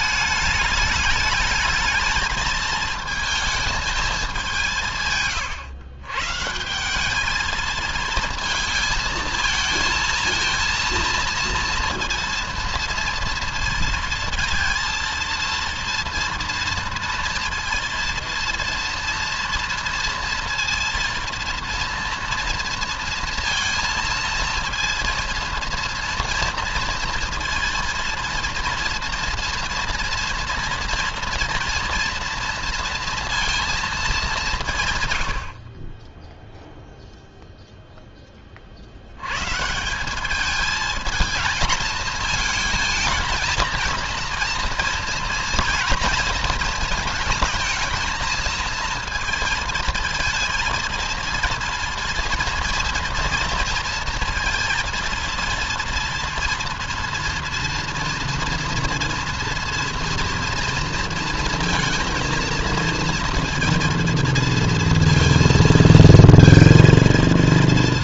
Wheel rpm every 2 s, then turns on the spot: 210, 220, 160, 190, 220, 230, 230, 230, 230, 230, 230, 230, 230, 230, 230, 230, 230, 130, 0, 80, 220, 220, 230, 220, 230, 230, 230, 230, 230, 240, 230, 230, 230, 230.
none